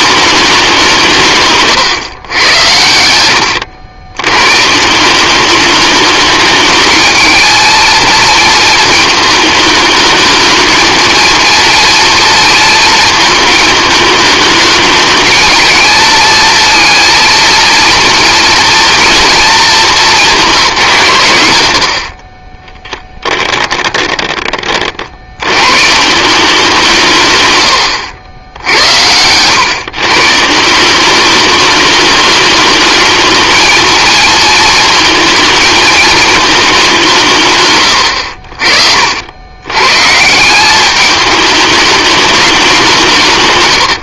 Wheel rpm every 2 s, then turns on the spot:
190, 80, 160, 210, 220, 230, 230, 210, 230, 230, 150, 10, 50, 170, 80, 180, 220, 230, 190, 60, 200, 180.
22-24